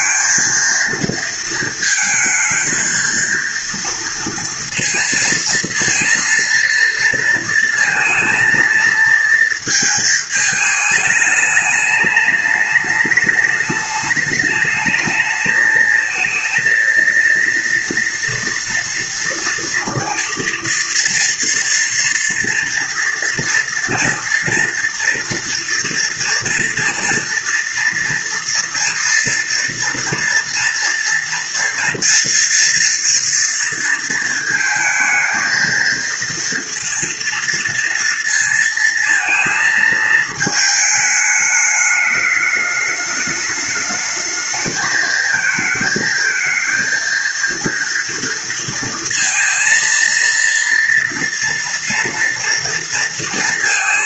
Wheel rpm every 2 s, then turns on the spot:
230, 220, 230, 230, 230, 220, 210, 210, 220, 230, 230, 230, 230, 230, 230, 230, 240, 220, 230, 230, 210, 210, 220, 230, 230, 230, 230.
none